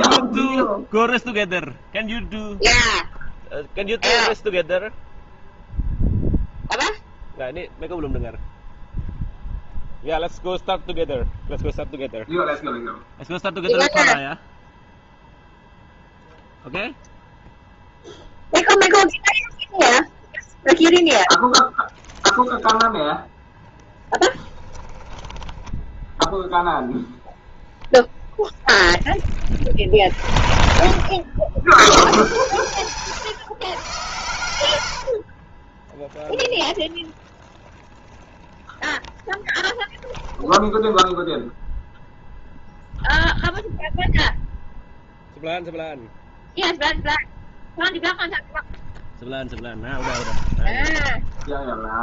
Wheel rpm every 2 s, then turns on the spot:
0, 0, 0, 0, 0, 0, 0, 0, 0, 0, 0, 0, 10, 0, 10, 60, 110, 90, 0, 0, 10, 0, 0, 0, 0, 10.
24-26 34-36 40-42